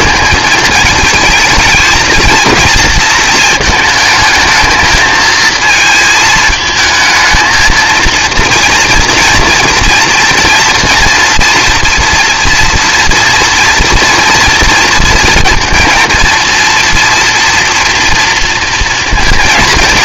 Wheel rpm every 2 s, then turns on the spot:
220, 220, 220, 220, 230, 230, 230, 230, 230, 230.
none